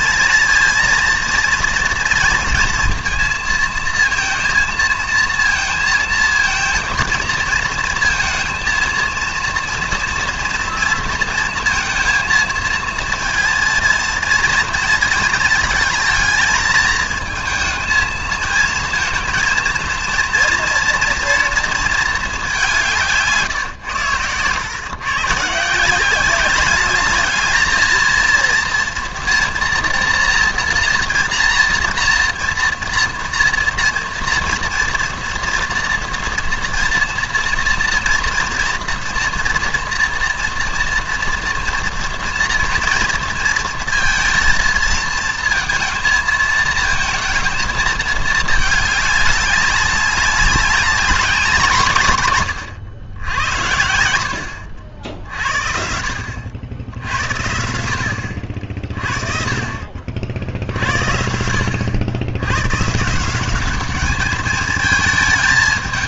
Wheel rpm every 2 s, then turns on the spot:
230, 230, 230, 230, 230, 240, 230, 230, 220, 230, 240, 210, 120, 190, 230, 230, 230, 230, 230, 230, 230, 230, 230, 220, 210, 190, 110, 70, 70, 60, 70, 120, 220.
none